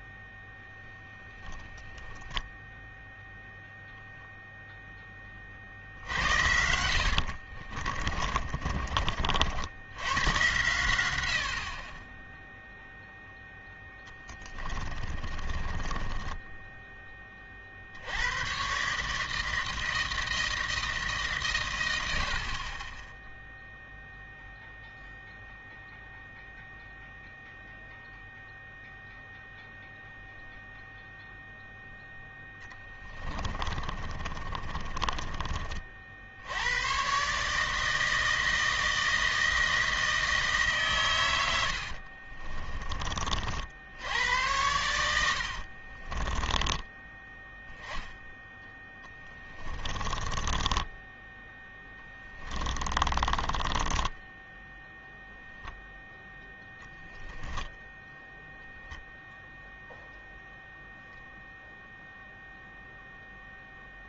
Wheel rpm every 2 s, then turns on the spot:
0, 0, 10, 70, 50, 90, 0, 20, 10, 150, 160, 20, 0, 0, 0, 0, 10, 20, 100, 160, 140, 30, 100, 20, 10, 10, 20, 10, 0, 10, 0, 0.
6-10 14-16 32-36 42-44 46-48 50-56